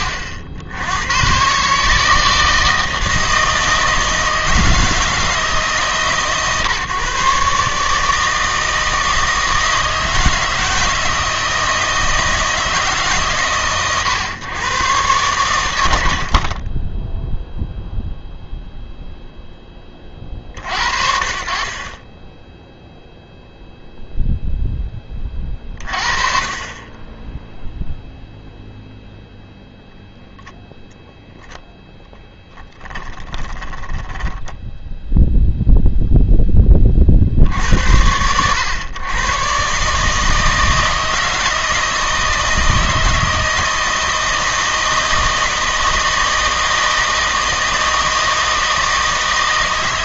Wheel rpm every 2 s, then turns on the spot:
80, 160, 160, 130, 160, 160, 150, 120, 20, 0, 50, 10, 10, 30, 0, 0, 10, 10, 10, 100, 160, 160, 160, 160, 160.
16-18 32-36